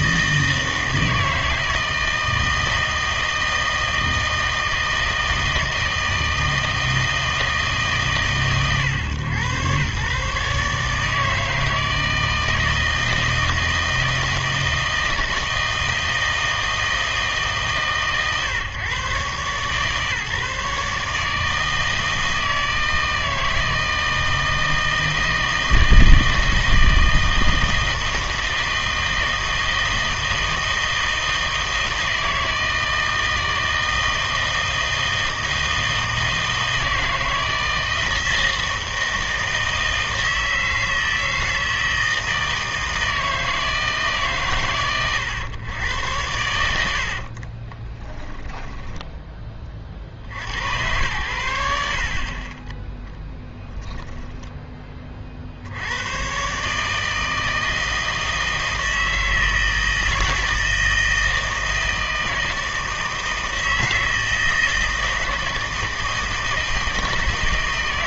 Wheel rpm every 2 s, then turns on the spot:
160, 160, 160, 160, 130, 140, 160, 160, 160, 140, 140, 160, 160, 160, 160, 160, 160, 160, 160, 160, 160, 160, 120, 80, 0, 90, 10, 10, 150, 160, 160, 160, 160, 160.
none